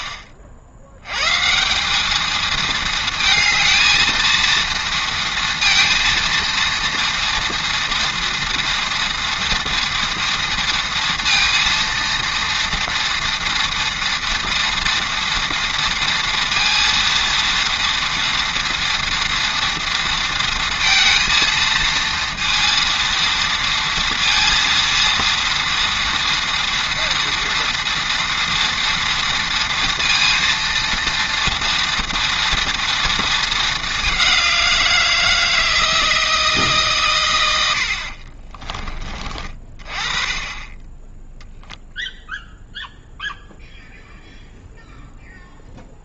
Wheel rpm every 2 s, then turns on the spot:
120, 230, 230, 230, 230, 230, 230, 230, 230, 230, 230, 230, 230, 230, 230, 230, 230, 170, 120, 30, 10, 0, 0.
none